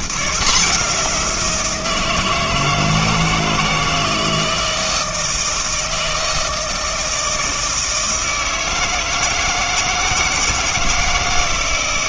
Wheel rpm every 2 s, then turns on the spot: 180, 160, 160, 160, 160, 160.
none